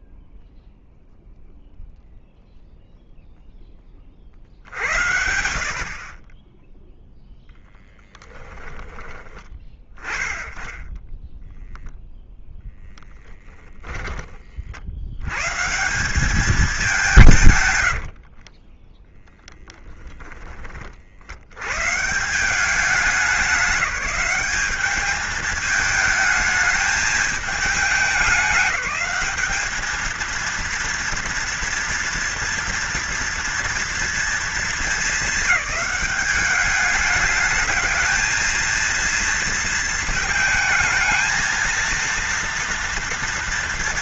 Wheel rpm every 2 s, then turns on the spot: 0, 0, 50, 20, 10, 10, 10, 30, 200, 40, 30, 180, 200, 210, 200, 230, 230, 230, 210, 230, 220, 230.
18-20